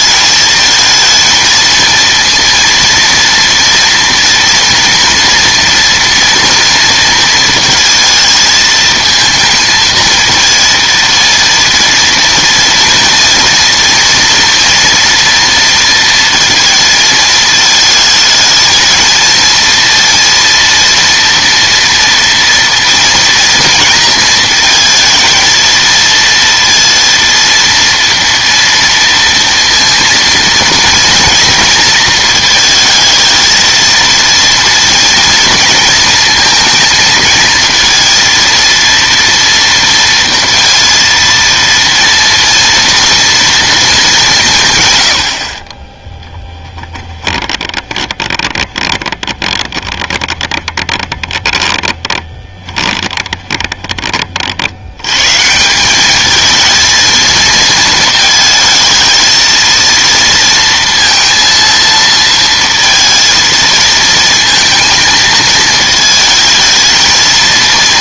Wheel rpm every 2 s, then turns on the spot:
220, 230, 230, 230, 220, 230, 230, 230, 230, 220, 230, 230, 230, 230, 230, 230, 220, 230, 230, 230, 230, 230, 140, 10, 20, 20, 20, 70, 230, 220, 230, 230, 220, 220.
46-54